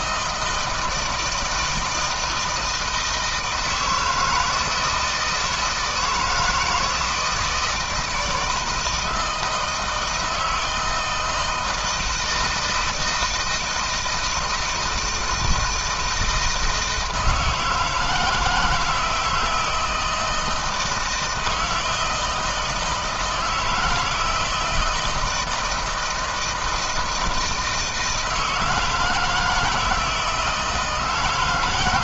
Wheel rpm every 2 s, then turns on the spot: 160, 160, 160, 170, 160, 160, 160, 160, 160, 160, 160, 160, 170, 160, 160, 160.
none